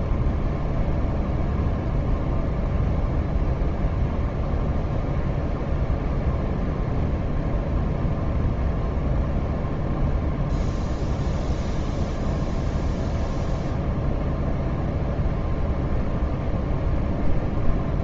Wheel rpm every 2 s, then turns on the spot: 0, 0, 0, 0, 0, 0, 0, 0, 0.
none